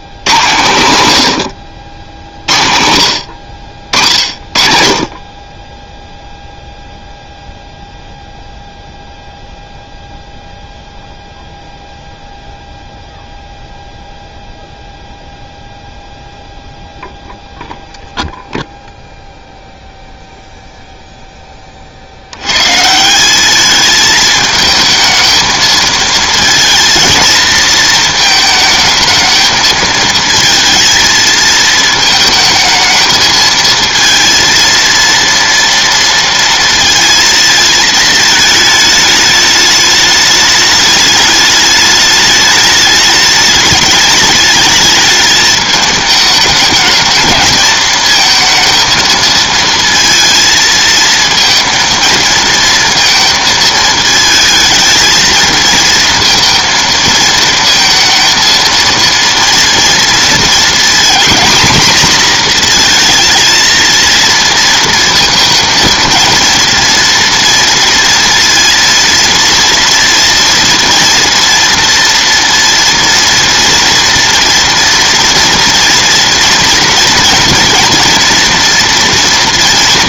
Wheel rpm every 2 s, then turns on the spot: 120, 80, 40, 0, 0, 0, 0, 0, 0, 0, 0, 150, 220, 230, 220, 220, 220, 230, 230, 220, 210, 210, 210, 220, 220, 220, 230, 220, 230, 230, 230, 230, 230, 230, 230, 230, 240, 230, 230, 240.
none